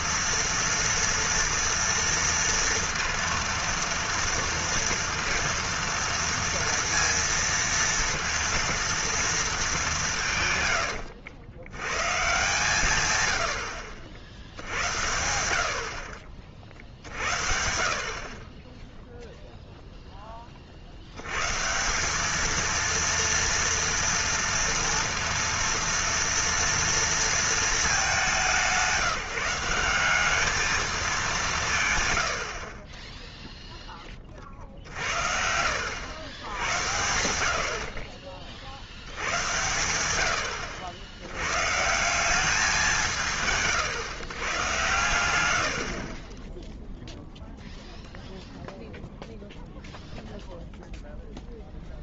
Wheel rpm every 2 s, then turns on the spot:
230, 230, 230, 230, 230, 110, 130, 80, 40, 20, 50, 220, 230, 230, 180, 220, 40, 50, 100, 60, 90, 190, 110, 0, 0, 0.
none